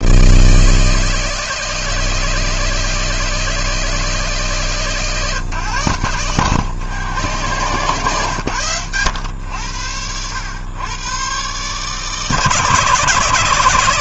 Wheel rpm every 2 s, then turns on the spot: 160, 160, 150, 130, 120, 110, 150.
none